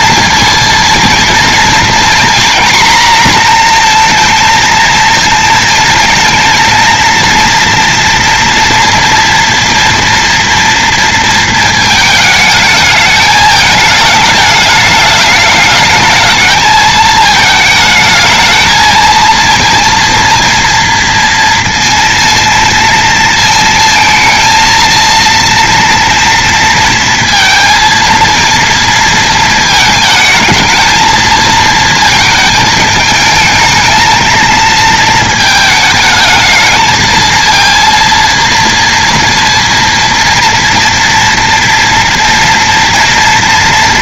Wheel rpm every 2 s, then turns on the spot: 230, 240, 230, 230, 230, 230, 220, 210, 220, 220, 230, 230, 220, 230, 230, 220, 220, 220, 220, 230, 230, 230.
none